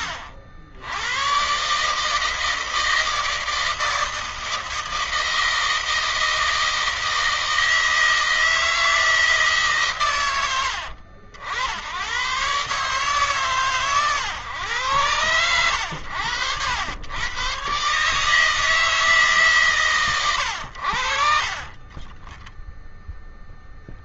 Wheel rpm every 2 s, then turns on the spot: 80, 160, 160, 160, 160, 80, 140, 110, 100, 160, 70, 0.
none